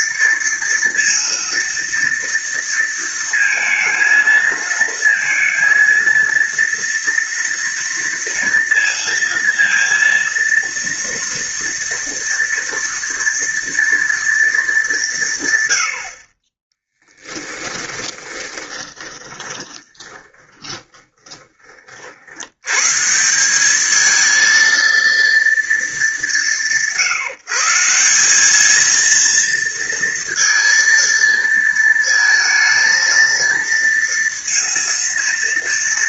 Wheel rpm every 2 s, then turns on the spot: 230, 230, 230, 230, 230, 230, 240, 210, 20, 20, 20, 110, 230, 160, 220, 230, 220, 230.
18-22